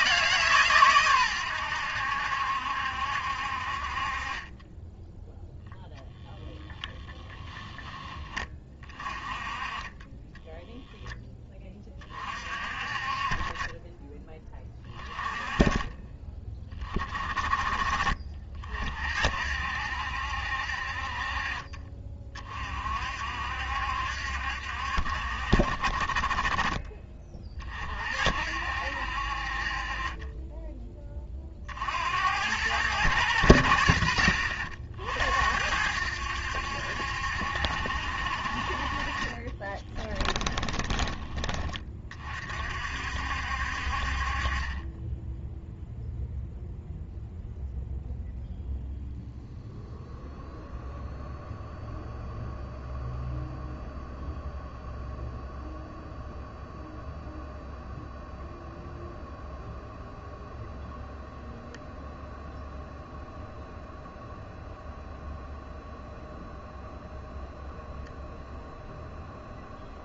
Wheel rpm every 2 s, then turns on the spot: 130, 70, 10, 10, 30, 0, 30, 20, 30, 50, 50, 50, 60, 30, 70, 20, 100, 60, 70, 40, 20, 60, 20, 0, 0, 0, 0, 0, 0, 0, 0, 0, 0, 0, 0.
6-8